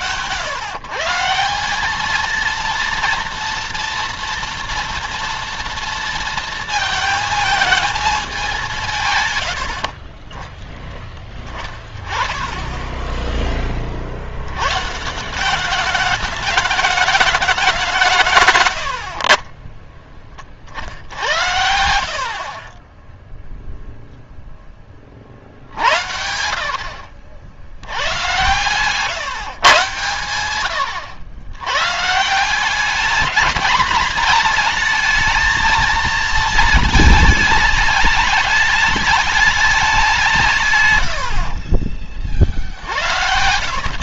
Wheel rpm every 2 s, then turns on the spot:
120, 230, 230, 230, 170, 10, 10, 110, 210, 100, 50, 30, 20, 50, 130, 100, 190, 220, 220, 210, 140, 60.
18-22 40-42